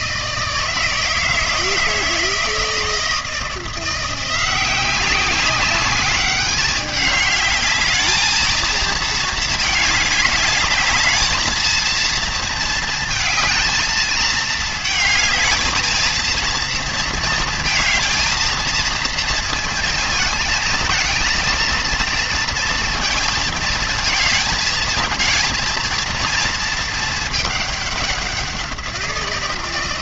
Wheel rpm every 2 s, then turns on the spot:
160, 160, 190, 210, 220, 220, 220, 220, 230, 220, 230, 230, 230, 220, 170.
none